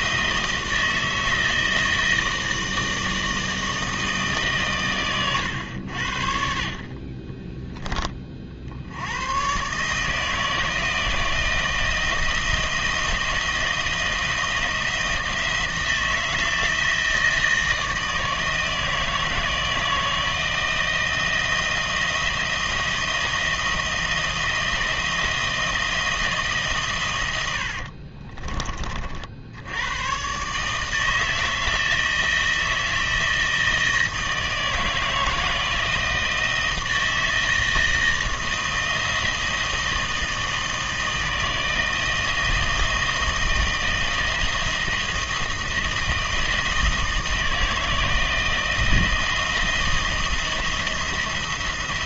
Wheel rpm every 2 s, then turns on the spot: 160, 160, 120, 40, 100, 160, 170, 170, 160, 160, 160, 160, 160, 110, 60, 160, 160, 160, 160, 160, 160, 160, 160, 160, 160, 170.
none